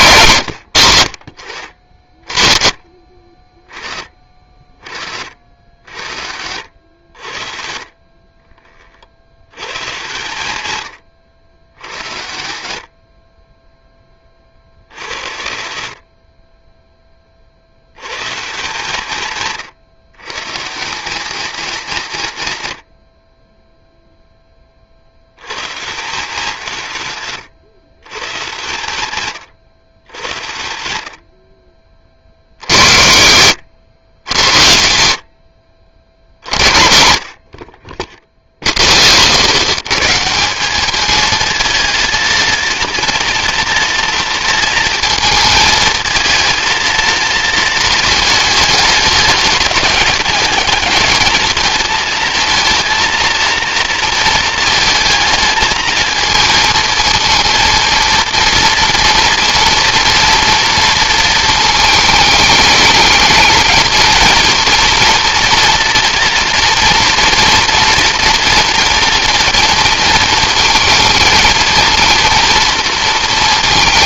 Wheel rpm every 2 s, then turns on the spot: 110, 30, 30, 40, 20, 60, 40, 30, 10, 80, 80, 60, 10, 80, 70, 40, 70, 80, 80, 10, 200, 230, 230, 230, 220, 220, 230, 230, 230, 230, 230, 220, 230, 230, 230, 230, 230.
none